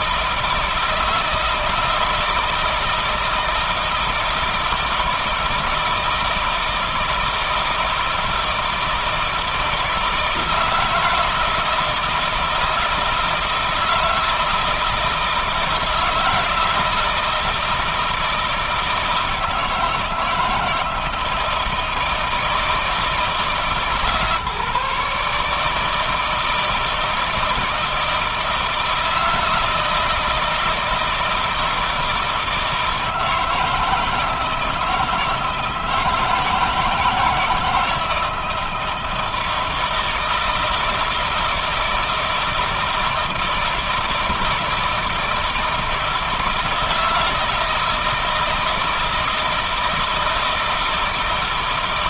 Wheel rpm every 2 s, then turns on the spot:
160, 160, 160, 160, 160, 160, 160, 160, 160, 160, 160, 170, 150, 160, 160, 160, 160, 160, 160, 160, 160, 160, 160, 160, 160, 160.
none